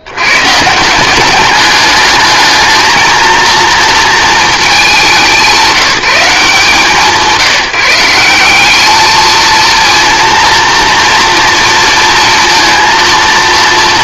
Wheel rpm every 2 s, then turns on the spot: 70, 210, 200, 150, 200, 230, 230.
none